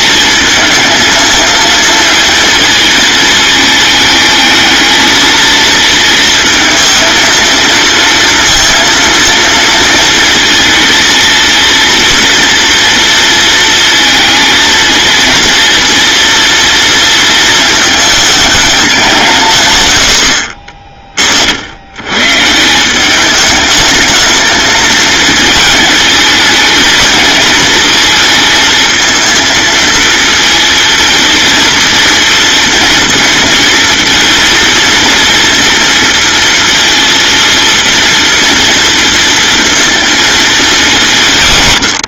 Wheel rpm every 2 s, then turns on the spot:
230, 220, 230, 230, 230, 230, 230, 230, 230, 200, 40, 180, 220, 220, 220, 220, 230, 230, 230, 230, 190.
20-22